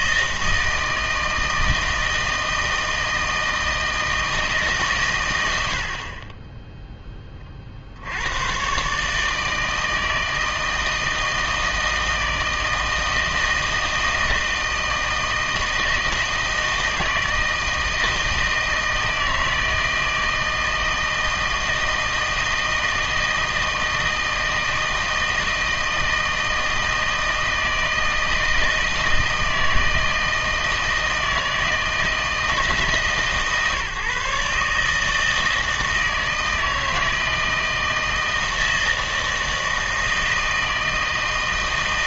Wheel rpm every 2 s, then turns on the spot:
160, 160, 140, 10, 130, 160, 160, 160, 160, 160, 160, 160, 160, 160, 160, 160, 150, 140, 160, 160, 160.
none